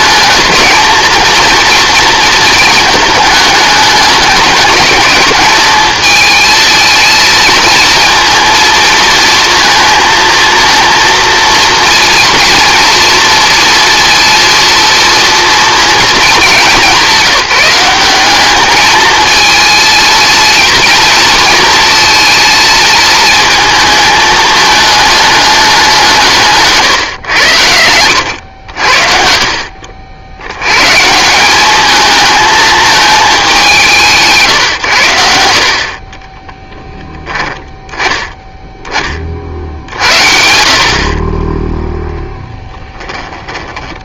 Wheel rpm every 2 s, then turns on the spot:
220, 220, 210, 220, 230, 230, 230, 230, 200, 210, 230, 230, 220, 150, 60, 130, 220, 120, 10, 20, 50, 10.
26-28 36-38